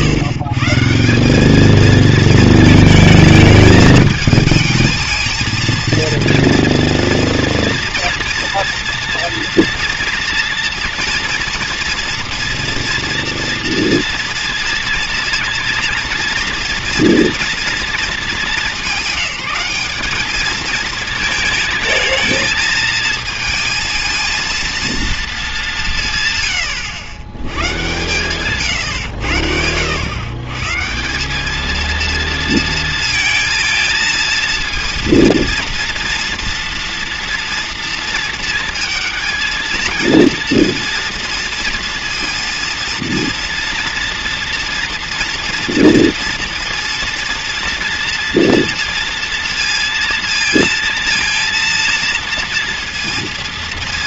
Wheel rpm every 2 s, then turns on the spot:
150, 230, 220, 230, 230, 230, 240, 230, 230, 210, 220, 220, 230, 110, 130, 140, 230, 220, 230, 220, 230, 230, 230, 230, 240, 230, 230.
none